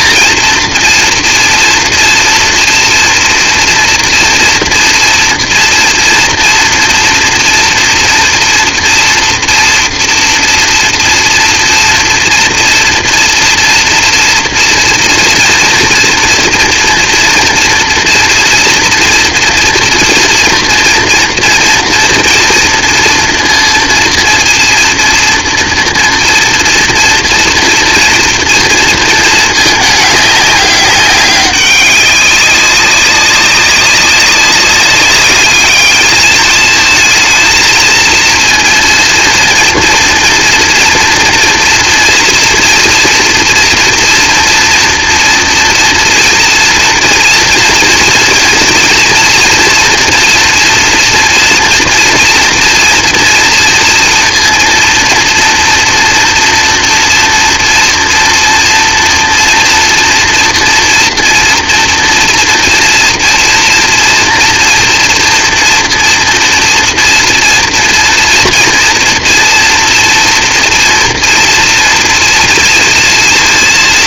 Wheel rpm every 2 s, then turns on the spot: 230, 230, 230, 230, 230, 240, 240, 230, 230, 230, 230, 230, 230, 230, 230, 200, 200, 200, 220, 230, 230, 230, 230, 230, 230, 230, 240, 230, 230, 230, 230, 240, 240, 230, 230, 230, 230.
none